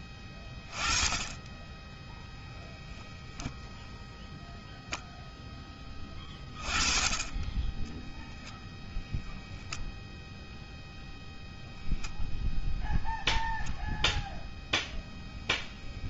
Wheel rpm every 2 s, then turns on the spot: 10, 0, 10, 10, 0, 0, 0, 0.
none